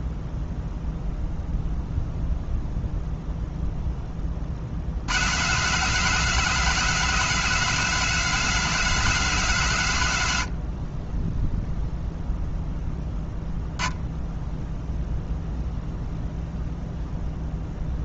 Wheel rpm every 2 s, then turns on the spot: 0, 0, 60, 190, 190, 50, 0, 0, 0.
none